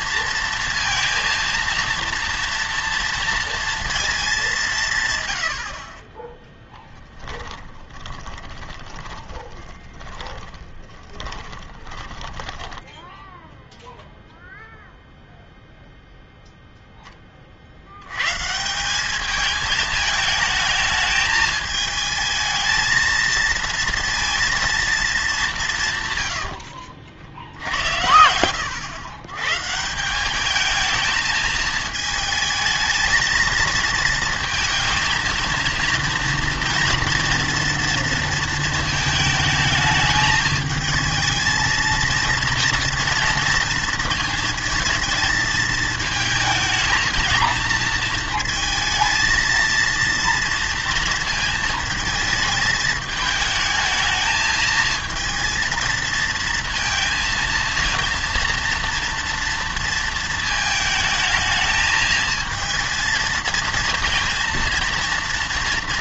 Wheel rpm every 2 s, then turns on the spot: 230, 230, 180, 10, 20, 10, 10, 0, 0, 170, 220, 220, 230, 80, 100, 210, 220, 220, 230, 230, 220, 230, 230, 230, 230, 230, 220, 220, 230, 230, 220, 220, 230.
6-14 26-28